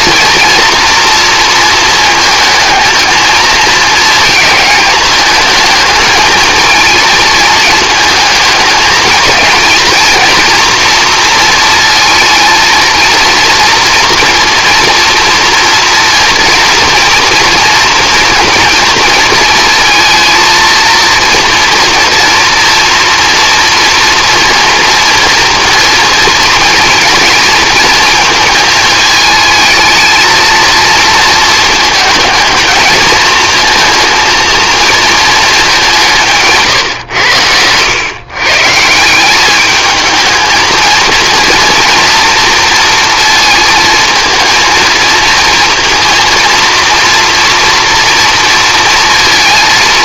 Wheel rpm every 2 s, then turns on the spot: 230, 220, 220, 230, 220, 230, 230, 230, 230, 220, 230, 230, 230, 230, 220, 230, 220, 230, 140, 150, 220, 230, 230, 230, 230.
none